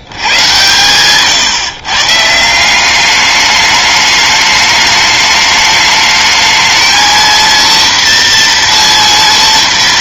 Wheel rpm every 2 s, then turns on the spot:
110, 160, 210, 220, 240.
none